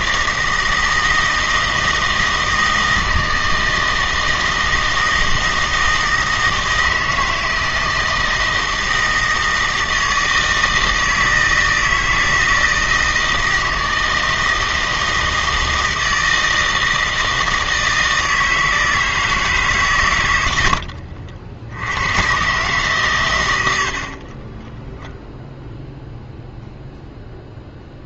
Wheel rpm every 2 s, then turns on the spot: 160, 160, 160, 160, 160, 160, 160, 160, 160, 160, 90, 130, 20, 0.
none